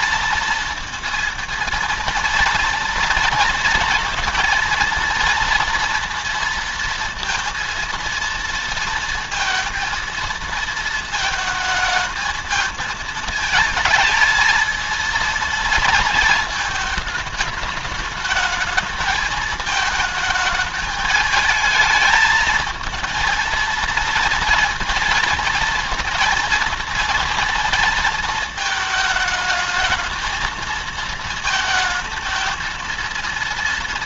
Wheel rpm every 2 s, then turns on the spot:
230, 230, 230, 230, 230, 230, 220, 220, 230, 220, 210, 220, 230, 230, 220, 220, 220.
none